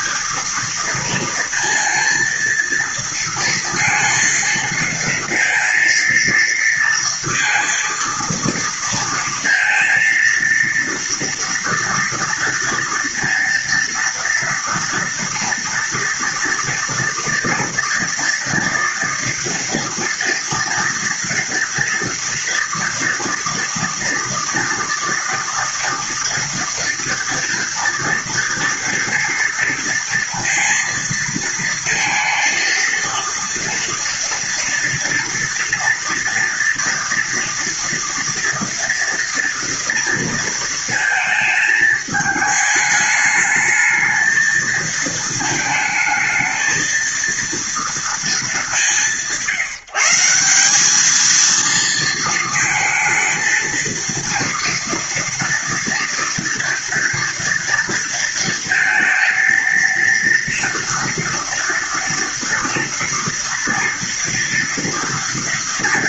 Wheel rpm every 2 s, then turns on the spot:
230, 230, 230, 230, 230, 230, 230, 230, 230, 230, 230, 230, 230, 230, 230, 230, 230, 230, 230, 230, 220, 210, 220, 230, 170, 220, 230, 240, 230, 230, 230, 240, 240.
none